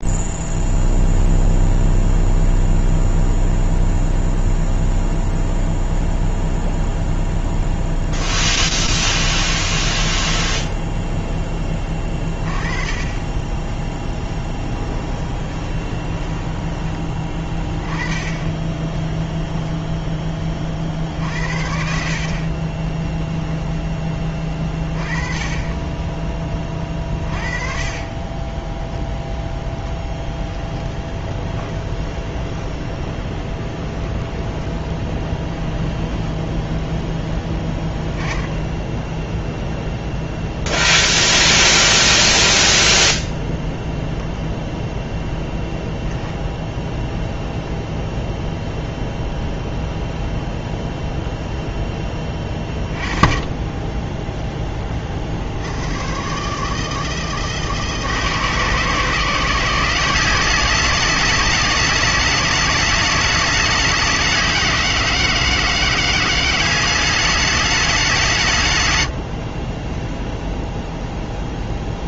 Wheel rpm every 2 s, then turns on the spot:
0, 0, 0, 0, 10, 20, 30, 10, 10, 10, 40, 20, 20, 20, 10, 10, 20, 20, 10, 10, 0, 0, 0, 0, 0, 0, 20, 20, 80, 140, 190, 210, 190, 200, 140, 0.
8-12 14-16 30-36